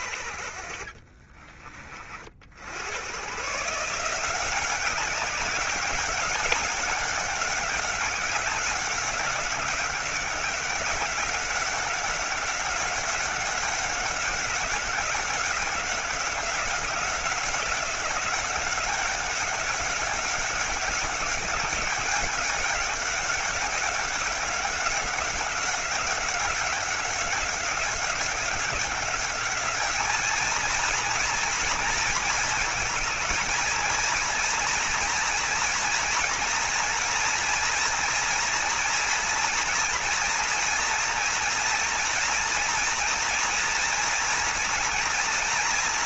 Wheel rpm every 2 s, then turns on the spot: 50, 100, 190, 200, 190, 190, 190, 190, 190, 190, 200, 190, 190, 200, 200, 230, 230, 230, 230, 230, 240, 230, 230.
none